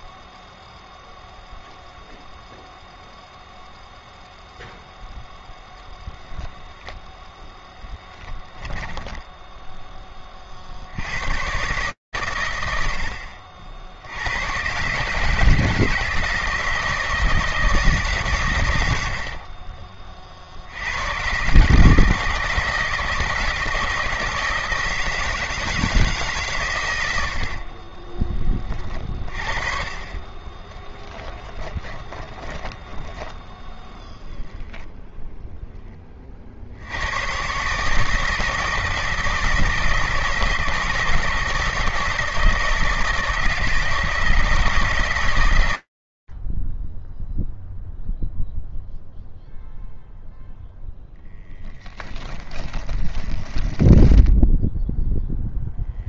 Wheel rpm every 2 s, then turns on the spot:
0, 0, 0, 0, 0, 120, 130, 100, 160, 140, 50, 160, 160, 140, 30, 20, 10, 0, 100, 160, 160, 160, 150, 10, 0, 0, 20, 0.
30-32 52-54